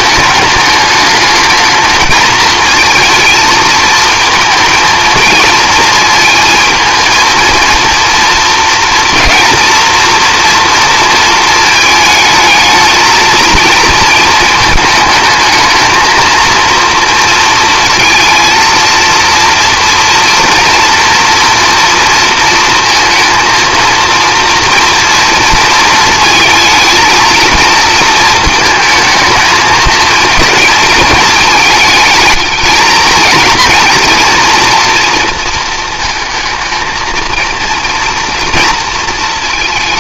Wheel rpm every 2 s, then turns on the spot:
210, 220, 220, 220, 230, 230, 220, 220, 230, 230, 230, 230, 230, 220, 220, 230, 220, 230, 220, 230.
none